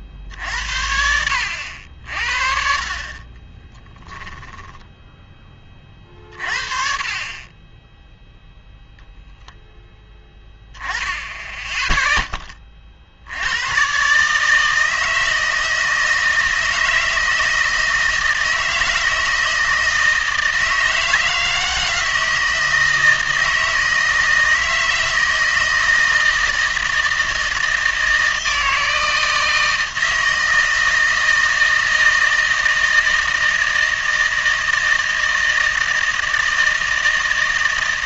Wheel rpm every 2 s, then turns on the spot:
60, 50, 10, 40, 0, 10, 30, 160, 160, 160, 160, 160, 160, 160, 160, 160, 160, 160, 160.
4-6